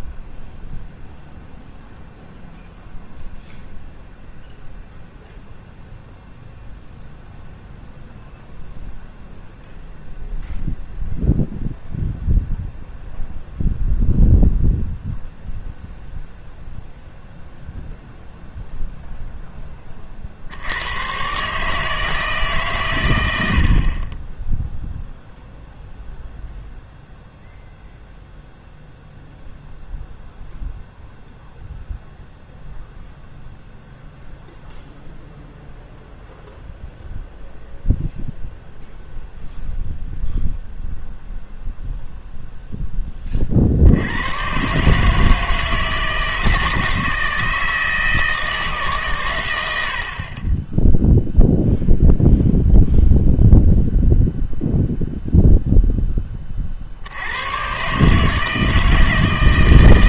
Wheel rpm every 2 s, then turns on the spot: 0, 0, 0, 0, 0, 0, 0, 0, 0, 0, 80, 140, 10, 0, 0, 0, 0, 0, 0, 0, 0, 0, 120, 160, 160, 10, 0, 0, 50, 160.
none